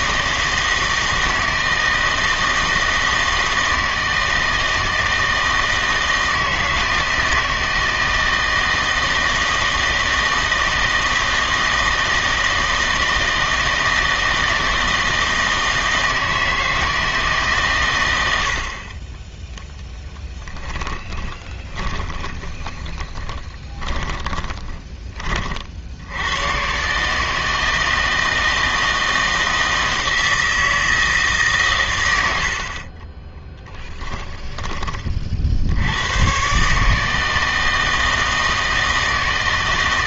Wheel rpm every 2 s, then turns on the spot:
160, 160, 160, 160, 160, 160, 160, 160, 160, 40, 10, 20, 20, 130, 160, 160, 50, 20, 140, 160.
20-26 32-34